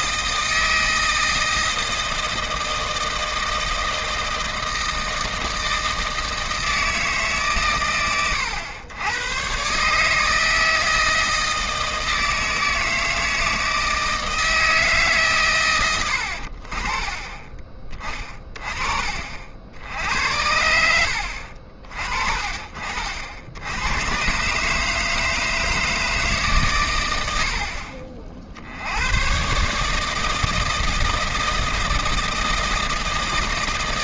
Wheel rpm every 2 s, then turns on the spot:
160, 160, 160, 160, 100, 160, 160, 160, 40, 30, 80, 50, 140, 120, 70, 160, 160.
none